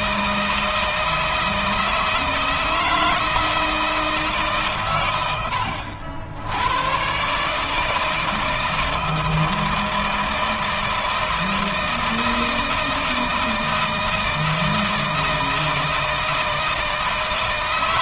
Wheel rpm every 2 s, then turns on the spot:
160, 160, 120, 110, 160, 160, 160, 160, 160.
none